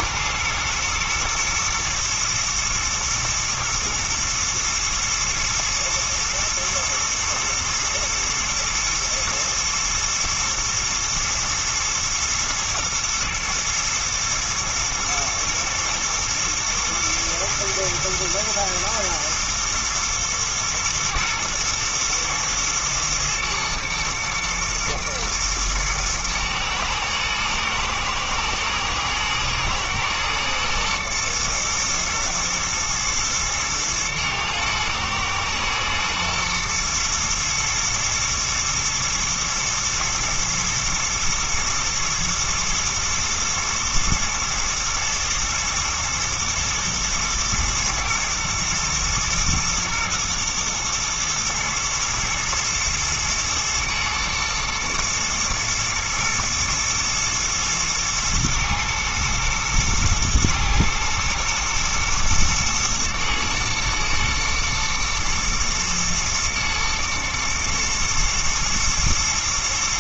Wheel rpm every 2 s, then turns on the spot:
110, 120, 110, 110, 110, 110, 110, 120, 110, 120, 120, 120, 110, 120, 110, 110, 120, 110, 110, 110, 120, 110, 110, 110, 120, 110, 110, 110, 110, 120, 110, 110, 110, 110, 110.
none